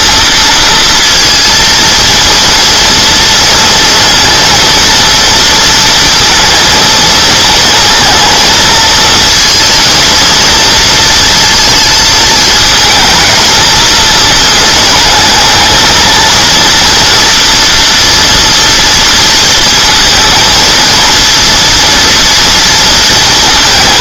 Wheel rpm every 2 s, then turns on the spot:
230, 230, 230, 230, 220, 230, 220, 220, 230, 230, 230, 230.
none